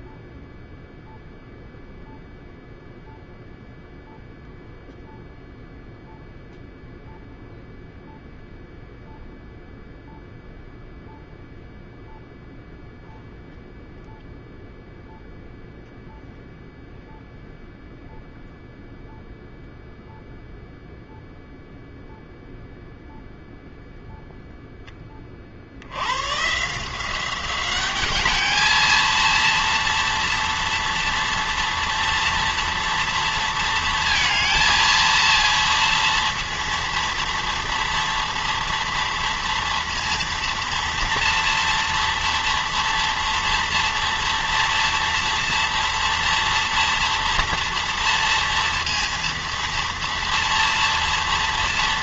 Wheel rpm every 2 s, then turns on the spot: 0, 0, 0, 0, 0, 0, 0, 0, 0, 0, 0, 0, 10, 130, 220, 230, 230, 230, 230, 230, 230, 230, 230, 230, 230, 230.
none